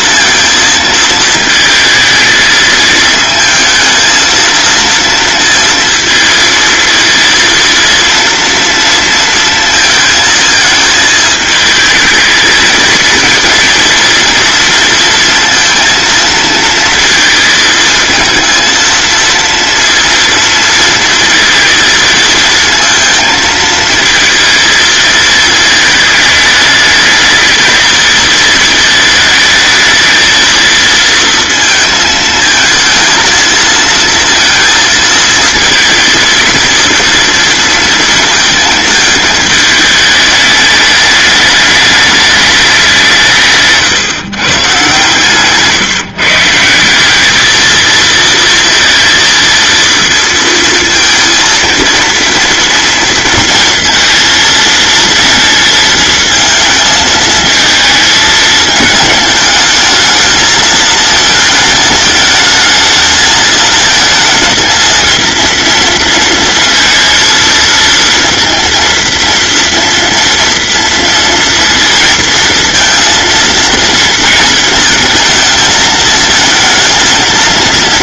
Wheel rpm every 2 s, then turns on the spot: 220, 220, 230, 230, 230, 220, 230, 230, 230, 230, 230, 230, 220, 220, 220, 230, 220, 230, 230, 220, 210, 180, 140, 180, 230, 230, 230, 230, 220, 210, 220, 220, 230, 230, 230, 230, 230, 220, 220.
none